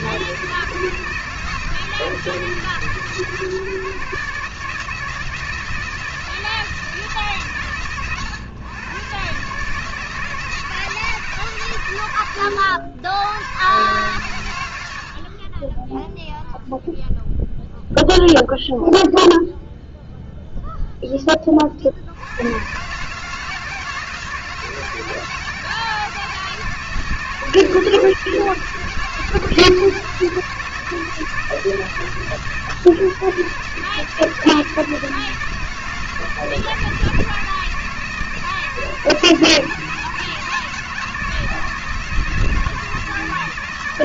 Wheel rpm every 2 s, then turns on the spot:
160, 160, 160, 160, 120, 160, 110, 110, 0, 0, 0, 120, 160, 160, 160, 160, 150, 160, 160, 160, 160, 160.
none